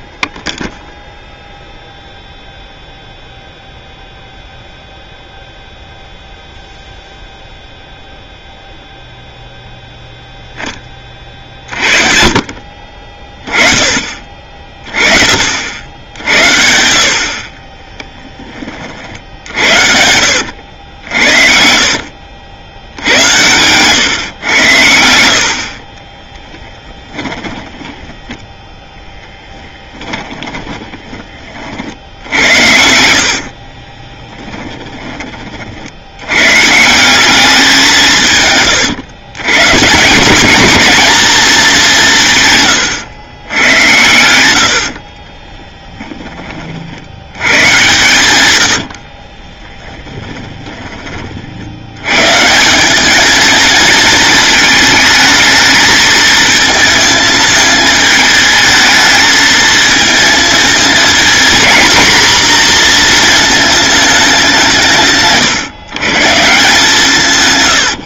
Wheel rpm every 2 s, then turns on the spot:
0, 0, 0, 0, 0, 20, 40, 30, 70, 50, 80, 80, 90, 20, 0, 20, 70, 20, 160, 130, 220, 130, 80, 50, 70, 20, 180, 220, 220, 220, 230, 240, 170, 170.
16-18 20-22 26-28 30-36 44-46 48-50